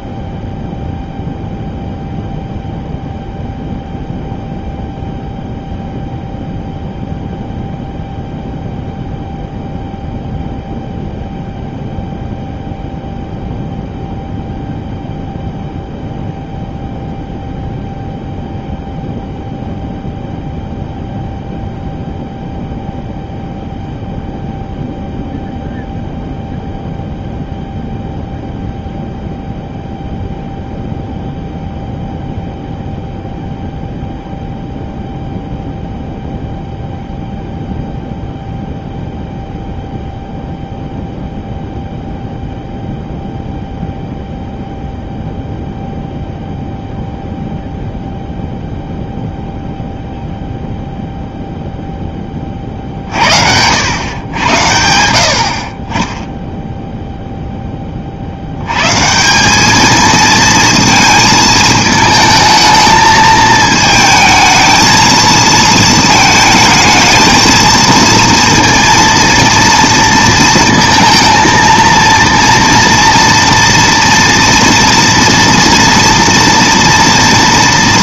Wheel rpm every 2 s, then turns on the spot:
0, 0, 0, 0, 0, 0, 0, 0, 0, 0, 0, 0, 0, 0, 0, 0, 0, 0, 0, 0, 0, 0, 0, 0, 0, 0, 30, 90, 0, 90, 230, 220, 220, 220, 230, 230, 230, 240, 230.
none